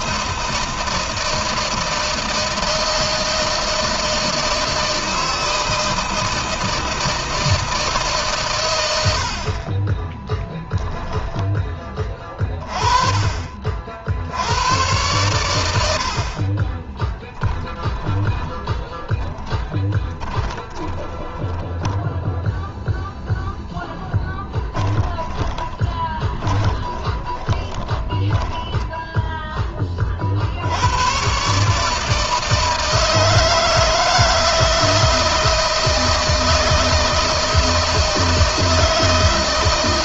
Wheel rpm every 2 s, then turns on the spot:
160, 160, 160, 160, 90, 10, 30, 100, 20, 20, 20, 0, 10, 20, 10, 110, 160, 160, 160, 160.
16-22 24-28